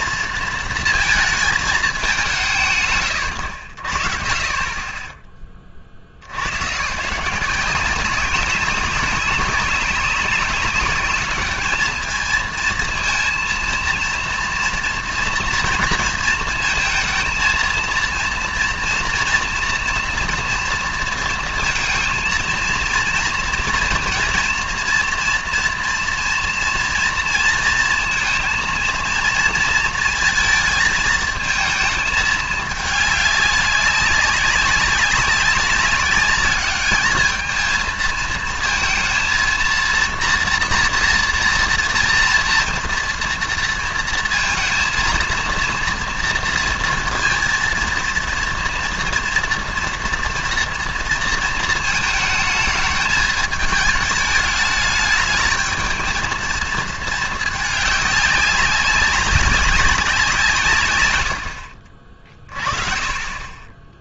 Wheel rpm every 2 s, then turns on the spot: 230, 140, 30, 140, 190, 190, 230, 240, 230, 230, 230, 230, 230, 230, 230, 220, 210, 190, 210, 230, 240, 230, 230, 230, 230, 230, 220, 210, 220, 200, 140, 30.
none